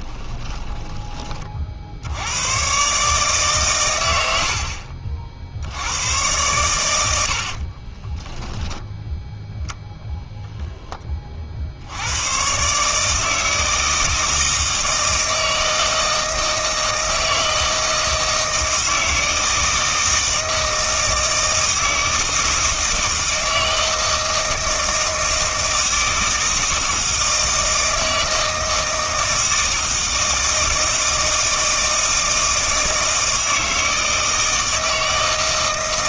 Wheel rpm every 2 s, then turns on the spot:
20, 120, 60, 100, 0, 0, 130, 160, 160, 160, 160, 160, 160, 160, 160, 160, 160, 160.
0-2